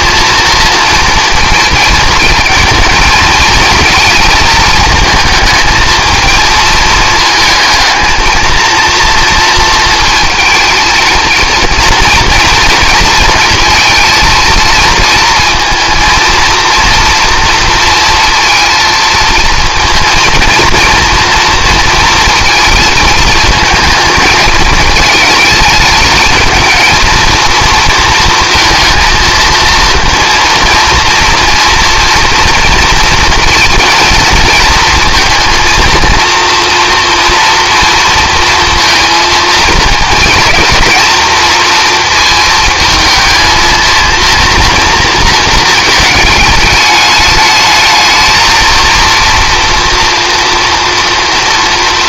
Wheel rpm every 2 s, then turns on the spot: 230, 220, 220, 220, 230, 230, 230, 230, 230, 230, 230, 220, 220, 220, 230, 230, 230, 230, 230, 230, 220, 220, 230, 210, 230, 230.
none